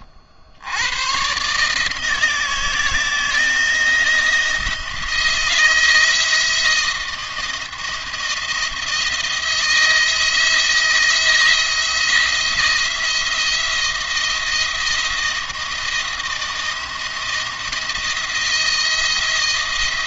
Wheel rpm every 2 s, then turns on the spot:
90, 160, 170, 170, 170, 160, 170, 170, 170, 170.
none